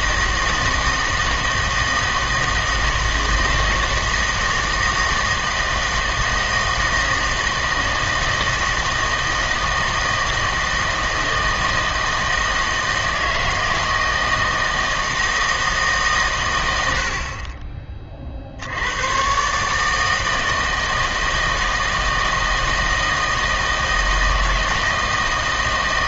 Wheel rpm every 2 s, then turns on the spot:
160, 160, 160, 160, 160, 160, 160, 160, 100, 70, 160, 160, 160.
none